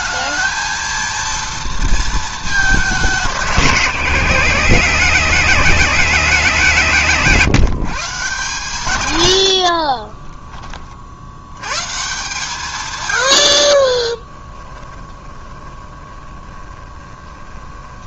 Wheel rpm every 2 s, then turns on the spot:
230, 200, 190, 180, 120, 30, 140, 20, 20.
14-18